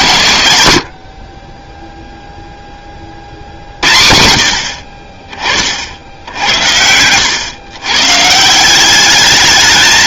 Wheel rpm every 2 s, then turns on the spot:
70, 40, 40, 90, 200.
6-8